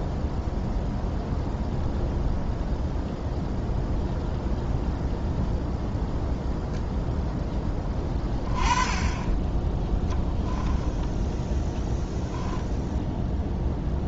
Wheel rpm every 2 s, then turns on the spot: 0, 0, 0, 0, 20, 10, 0.
10-12